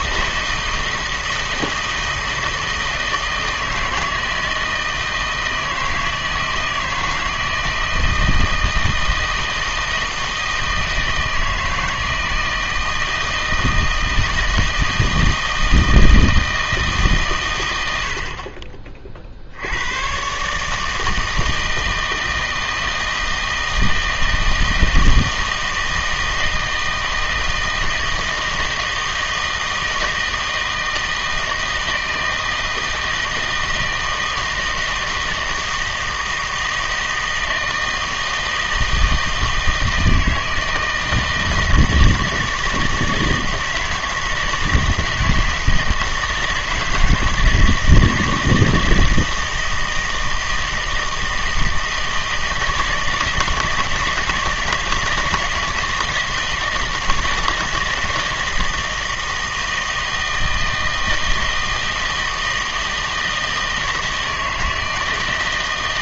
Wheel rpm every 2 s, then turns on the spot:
160, 160, 160, 160, 160, 160, 160, 160, 160, 40, 150, 160, 160, 160, 160, 160, 160, 160, 160, 160, 160, 160, 160, 160, 160, 160, 160, 160, 160, 160, 160, 160, 160.
none